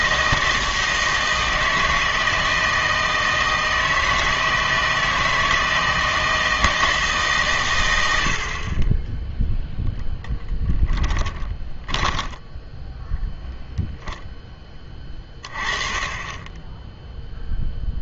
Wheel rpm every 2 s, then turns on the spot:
160, 160, 160, 160, 40, 10, 10, 10, 10.
10-14